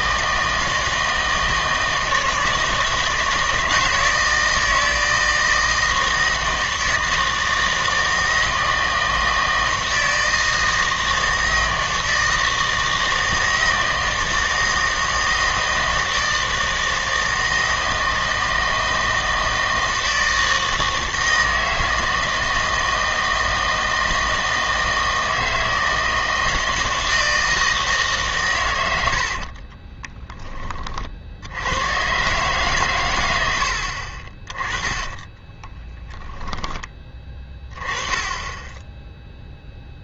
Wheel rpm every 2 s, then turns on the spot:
160, 160, 160, 160, 160, 160, 160, 160, 160, 160, 160, 160, 160, 160, 100, 40, 130, 20, 20, 10.
34-38